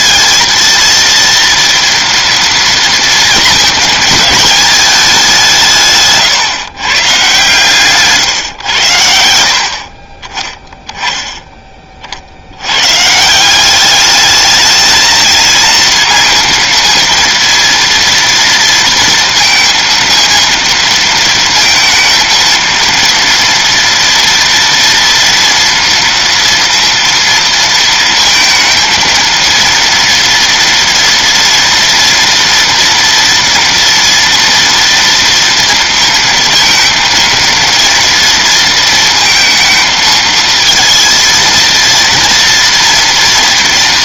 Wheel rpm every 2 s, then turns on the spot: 230, 220, 180, 130, 70, 10, 160, 230, 230, 230, 230, 230, 230, 230, 230, 230, 230, 230, 230, 230, 230, 230.
none